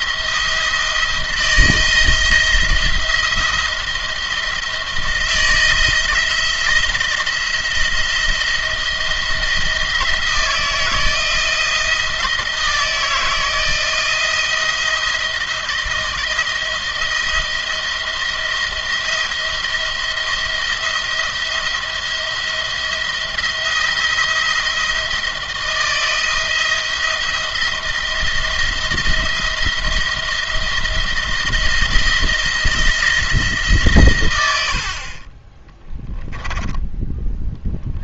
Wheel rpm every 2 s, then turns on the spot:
170, 170, 170, 170, 170, 160, 170, 170, 170, 170, 170, 170, 170, 170, 170, 170, 170, 90, 10.
36-38